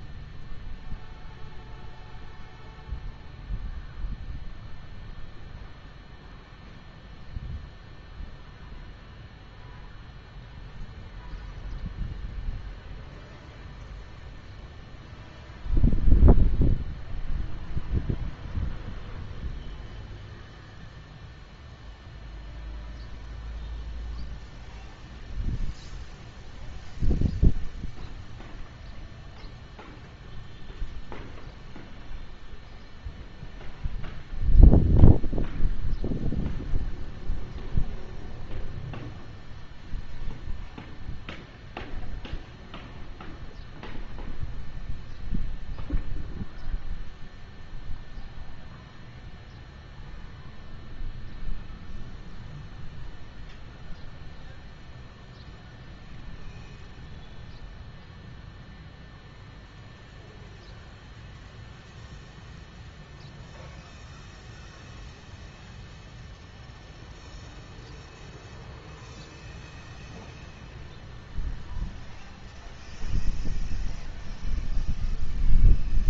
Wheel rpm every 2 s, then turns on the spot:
0, 0, 0, 0, 0, 0, 0, 0, 0, 0, 0, 0, 0, 0, 0, 0, 0, 0, 0, 0, 0, 0, 0, 0, 0, 0, 0, 0, 0, 0, 0, 0, 0, 0, 0, 0, 0, 0.
none